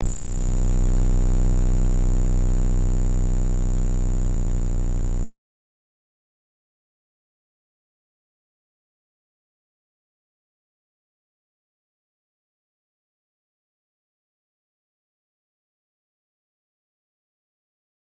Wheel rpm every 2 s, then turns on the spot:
0, 0, 0, 0, 0, 0, 0, 0, 0.
none